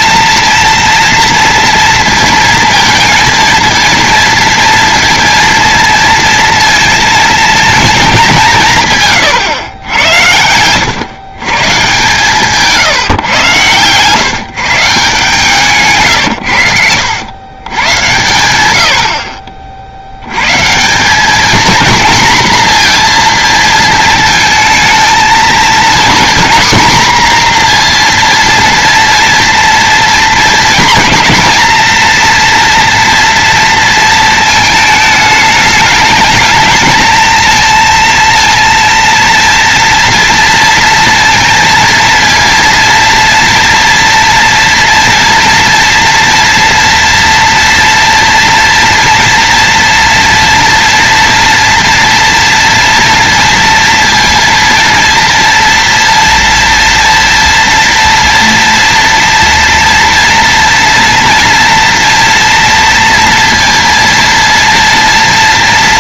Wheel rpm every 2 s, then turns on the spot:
230, 230, 230, 230, 150, 110, 140, 150, 100, 70, 180, 230, 220, 250, 230, 240, 230, 220, 230, 230, 230, 230, 230, 230, 230, 230, 230, 230, 230, 230, 230, 230, 230.
none